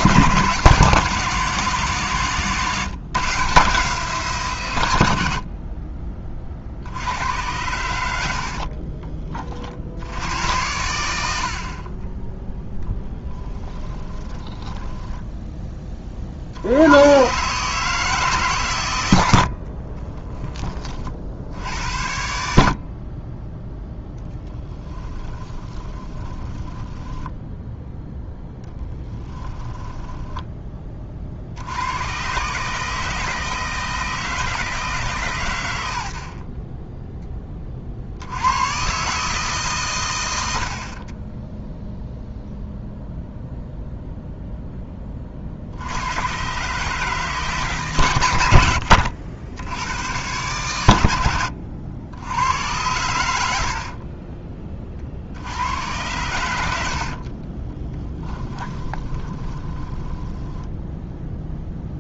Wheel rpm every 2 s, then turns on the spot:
160, 150, 130, 60, 40, 90, 0, 10, 80, 120, 30, 70, 10, 10, 10, 20, 150, 160, 30, 120, 50, 0, 0, 130, 70, 110, 100, 30, 70, 20, 10.
8-10 14-16 24-30 48-50 56-62